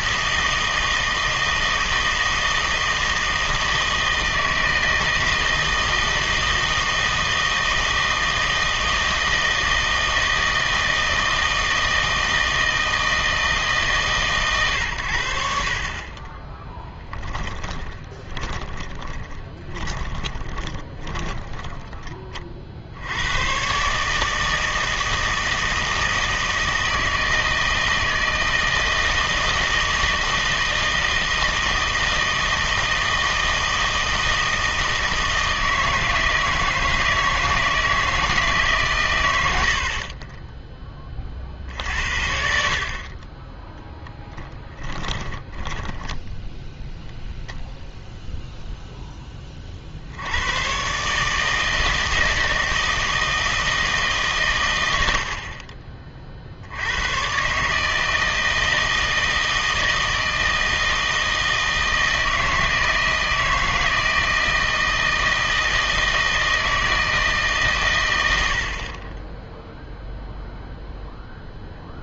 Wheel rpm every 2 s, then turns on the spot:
160, 160, 160, 160, 160, 160, 160, 110, 10, 20, 20, 50, 160, 160, 160, 160, 160, 160, 160, 140, 10, 50, 10, 0, 0, 110, 160, 100, 70, 160, 160, 160, 160, 160, 70, 0.
16-22 44-46